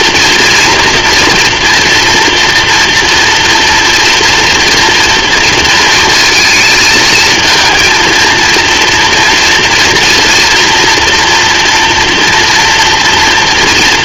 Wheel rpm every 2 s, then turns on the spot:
230, 240, 230, 220, 230, 230, 230.
none